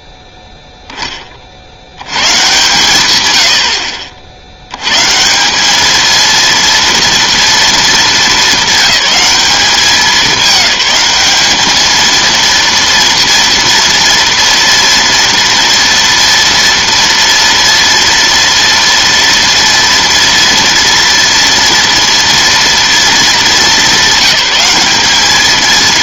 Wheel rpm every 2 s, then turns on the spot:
20, 120, 170, 230, 210, 200, 230, 230, 230, 230, 240, 220, 220.
none